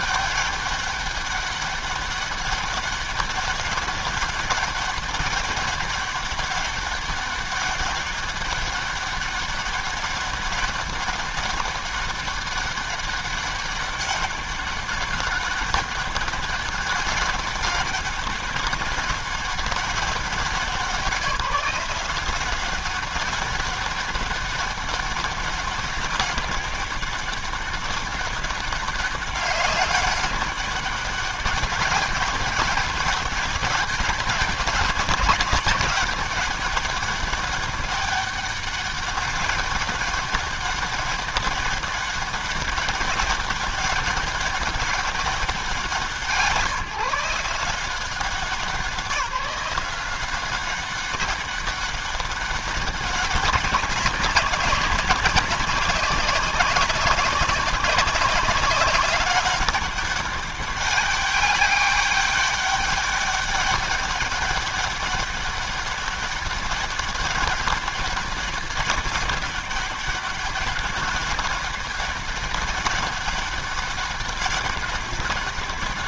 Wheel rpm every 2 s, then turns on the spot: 200, 200, 200, 200, 200, 200, 200, 200, 200, 190, 190, 190, 200, 200, 200, 200, 200, 190, 200, 200, 200, 200, 200, 170, 160, 190, 200, 190, 190, 200, 200, 200, 200, 200, 200, 200, 200, 200.
none